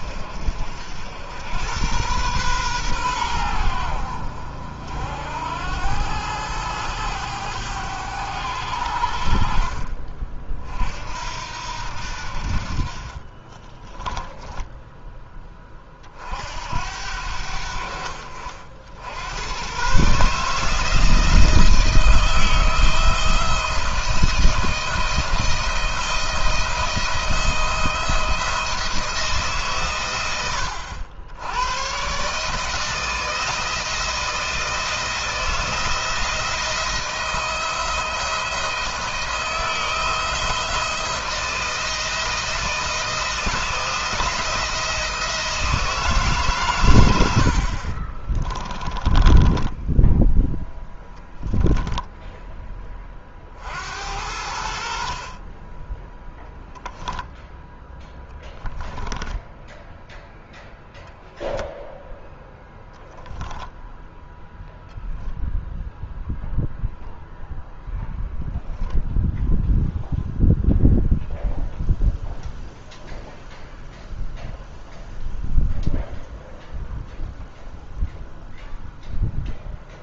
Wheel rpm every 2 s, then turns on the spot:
70, 110, 70, 100, 80, 50, 50, 10, 70, 80, 160, 170, 170, 170, 160, 90, 160, 170, 170, 160, 160, 170, 170, 120, 20, 0, 10, 70, 0, 10, 0, 0, 0, 0, 10, 0, 0, 0, 0, 0.
12-16 48-50 58-60